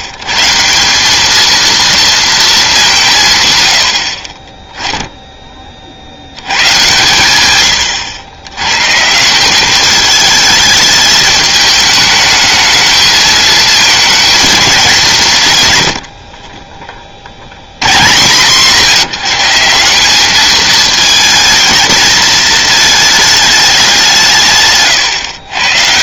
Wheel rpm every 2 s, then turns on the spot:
140, 210, 20, 110, 110, 220, 220, 220, 40, 130, 210, 220, 130.
16-18 24-26